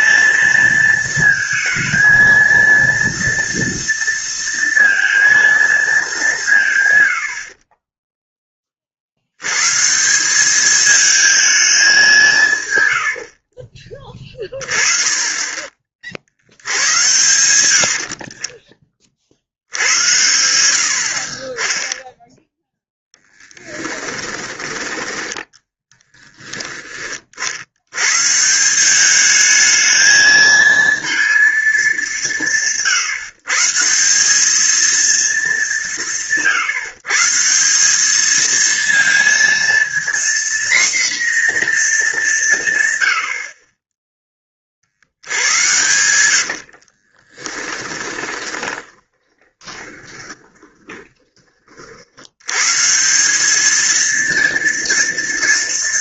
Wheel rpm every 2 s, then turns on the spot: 230, 230, 230, 160, 20, 200, 160, 20, 80, 30, 80, 0, 10, 10, 160, 220, 170, 210, 150, 220, 240, 160, 20, 60, 20, 20, 110, 230.
46-52